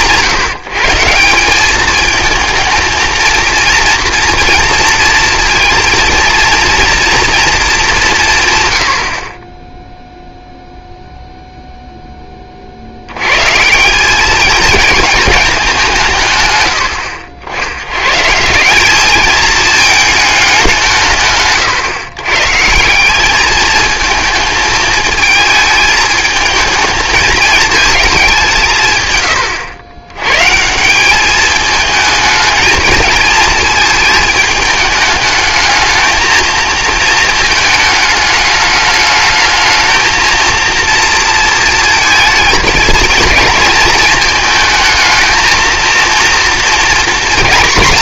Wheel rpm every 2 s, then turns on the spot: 150, 220, 230, 230, 130, 0, 40, 220, 110, 170, 190, 170, 220, 220, 150, 160, 220, 210, 220, 210, 230, 220, 220, 230.
none